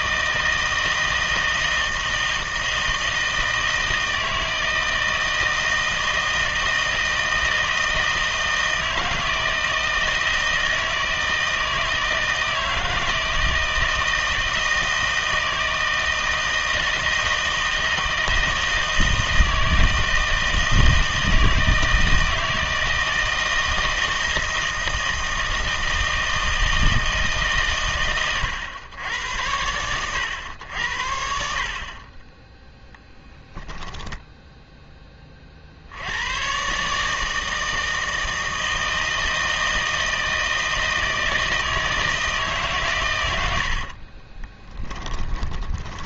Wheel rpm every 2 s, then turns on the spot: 160, 160, 160, 160, 160, 160, 160, 160, 160, 160, 160, 160, 160, 160, 100, 90, 10, 0, 140, 160, 160, 140, 10.
44-46